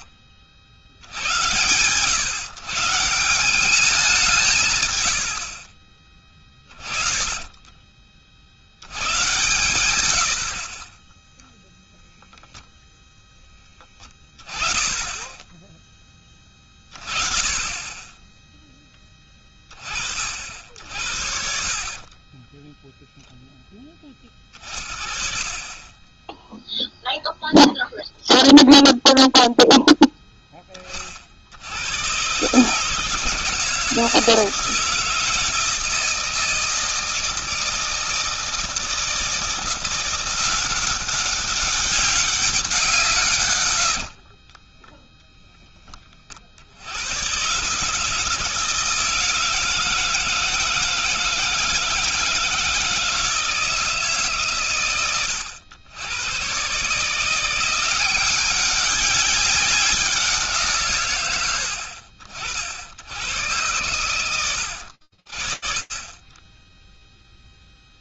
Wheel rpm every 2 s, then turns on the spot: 70, 140, 140, 20, 90, 30, 0, 10, 30, 10, 50, 10, 30, 0, 0, 20, 150, 160, 160, 160, 180, 180, 20, 70, 160, 160, 160, 120, 140, 190, 150, 70, 80, 10.
6-8 22-26 44-46